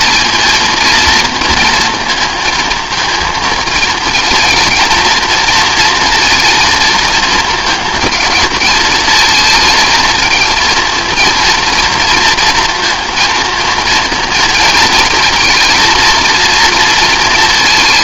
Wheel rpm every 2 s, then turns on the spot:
230, 220, 230, 230, 220, 230, 230, 230, 230.
none